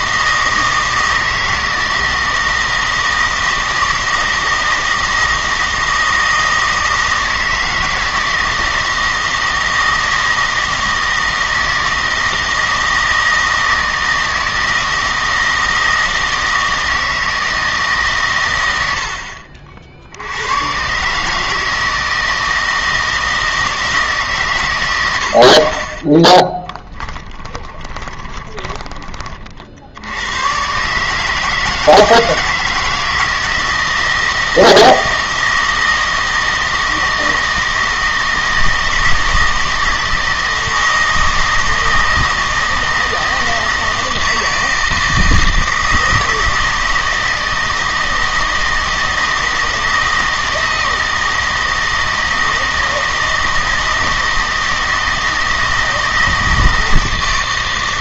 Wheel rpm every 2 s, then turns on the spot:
160, 160, 160, 160, 160, 160, 160, 160, 160, 90, 120, 160, 130, 20, 20, 130, 160, 160, 160, 160, 160, 160, 160, 160, 160, 160, 160, 160, 160.
26-30